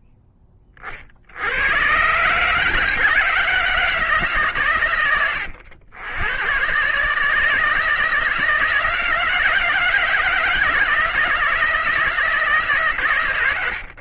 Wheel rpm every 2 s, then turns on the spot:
40, 150, 120, 140, 160, 160, 140.
none